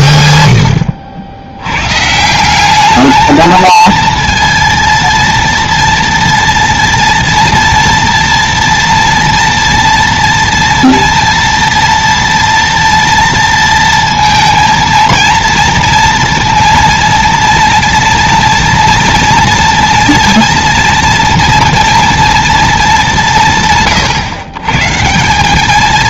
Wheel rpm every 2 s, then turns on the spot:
80, 200, 230, 230, 230, 230, 230, 230, 230, 230, 230, 210, 150.
none